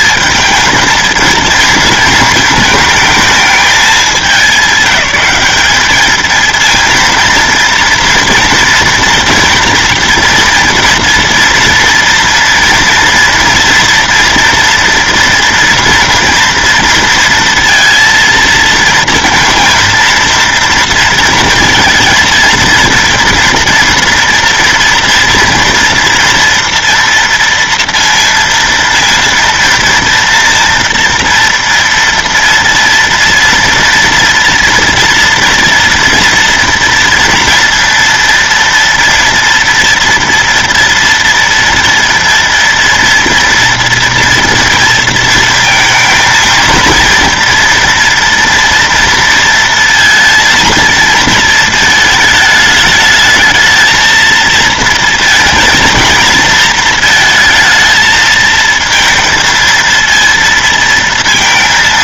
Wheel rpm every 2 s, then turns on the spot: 220, 220, 200, 230, 230, 230, 230, 230, 230, 230, 230, 230, 230, 240, 230, 230, 230, 230, 230, 230, 230, 230, 230, 230, 230, 230, 220, 230, 220, 220, 230.
none